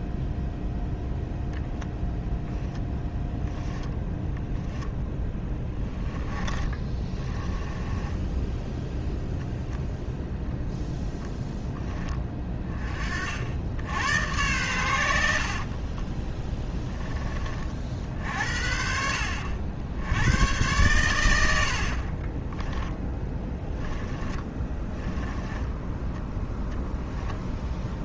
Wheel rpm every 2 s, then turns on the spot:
0, 10, 10, 20, 0, 0, 30, 100, 10, 60, 110, 10, 20, 0.
4-8 22-26